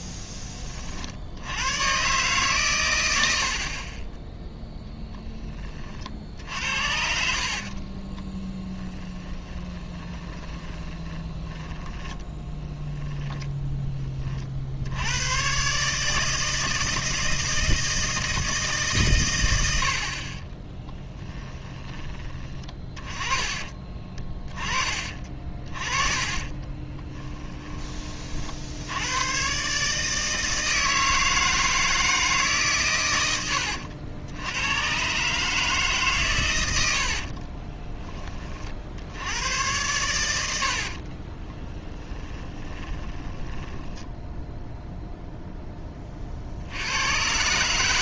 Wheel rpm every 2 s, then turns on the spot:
50, 100, 0, 60, 20, 20, 10, 70, 160, 150, 20, 20, 30, 20, 80, 160, 130, 110, 80, 60, 70, 20, 10, 90.
8-14 20-22 26-28 40-44